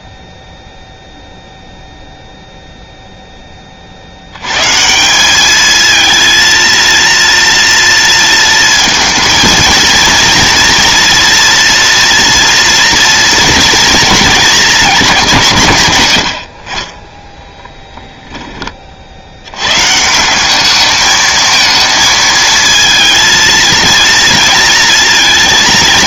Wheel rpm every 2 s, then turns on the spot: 0, 0, 150, 230, 230, 230, 230, 200, 30, 30, 210, 230, 230.
none